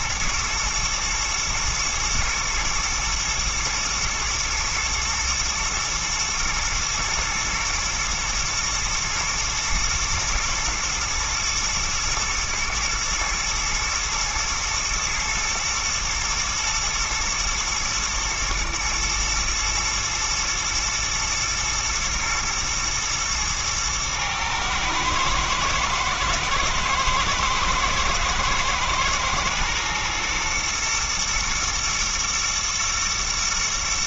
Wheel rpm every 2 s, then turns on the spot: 110, 110, 110, 110, 120, 120, 110, 120, 120, 120, 110, 110, 110, 110, 110, 110, 120.
none